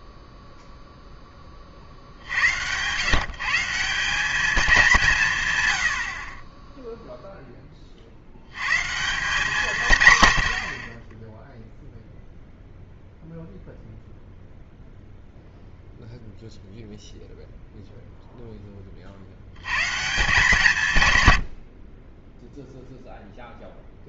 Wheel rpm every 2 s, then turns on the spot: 10, 140, 170, 0, 160, 10, 0, 0, 0, 60, 110, 0.
none